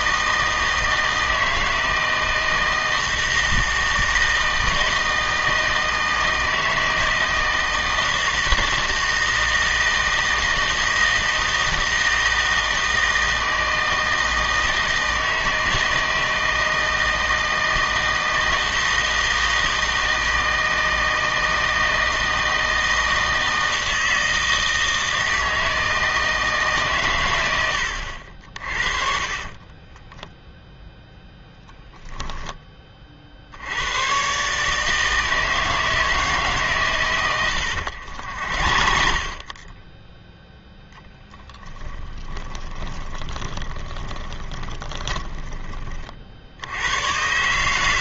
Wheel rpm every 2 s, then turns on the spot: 160, 160, 170, 160, 160, 160, 160, 160, 160, 160, 160, 160, 160, 140, 40, 0, 20, 150, 130, 50, 10, 20, 20, 90.
28-30 38-46